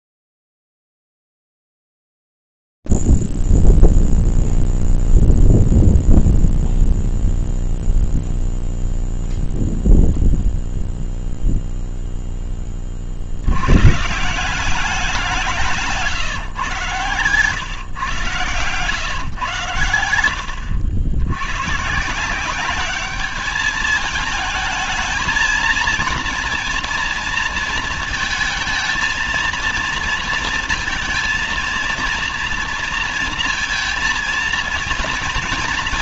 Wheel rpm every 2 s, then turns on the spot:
0, 0, 0, 0, 0, 0, 0, 120, 160, 130, 100, 140, 210, 230, 230, 230, 230, 220.
none